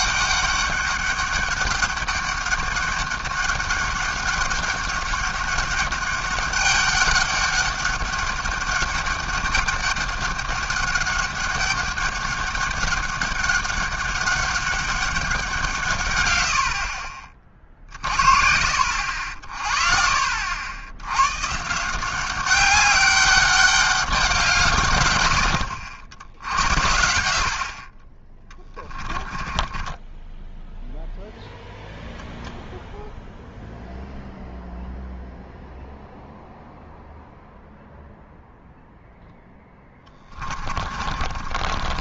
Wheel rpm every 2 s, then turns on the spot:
200, 200, 200, 200, 200, 200, 200, 200, 90, 60, 60, 190, 170, 70, 20, 10, 0, 0, 0, 0, 20.
28-32 40-42